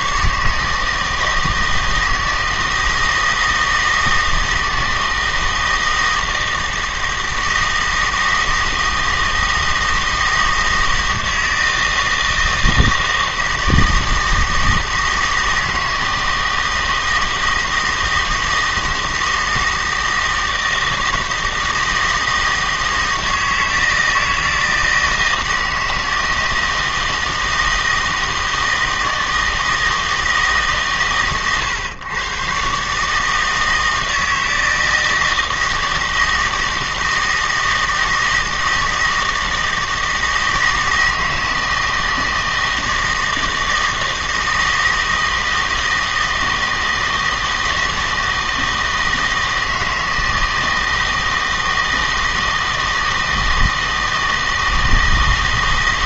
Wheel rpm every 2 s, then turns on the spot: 150, 160, 160, 160, 160, 160, 160, 160, 160, 160, 160, 160, 160, 160, 160, 150, 130, 160, 160, 160, 160, 160, 160, 160, 160, 160, 160, 160.
none